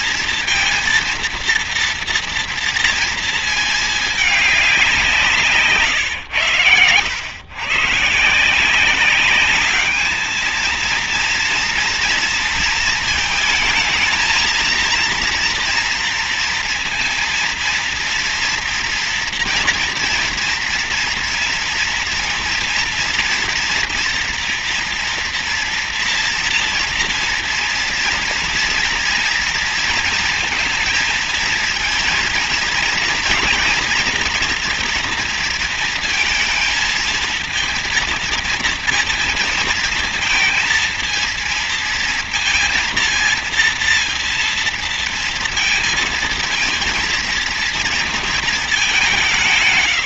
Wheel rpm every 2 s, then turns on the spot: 230, 230, 210, 110, 160, 230, 230, 230, 230, 230, 230, 230, 230, 230, 230, 230, 230, 230, 220, 230, 230, 230, 230, 230, 210.
none